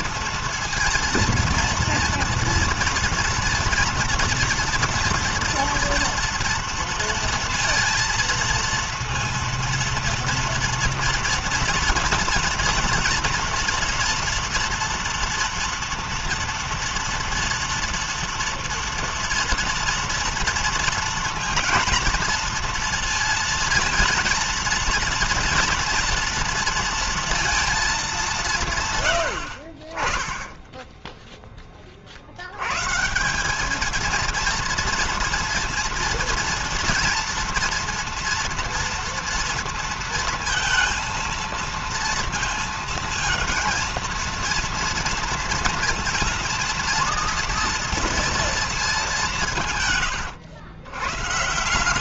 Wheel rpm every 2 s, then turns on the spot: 230, 230, 230, 230, 230, 230, 230, 240, 240, 230, 230, 230, 230, 230, 180, 20, 80, 230, 230, 230, 230, 230, 230, 230, 230, 110.
none